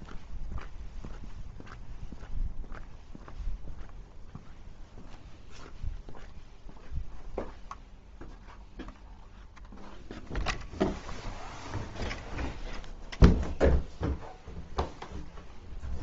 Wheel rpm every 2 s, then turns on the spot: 0, 0, 0, 0, 0, 0, 0, 0.
none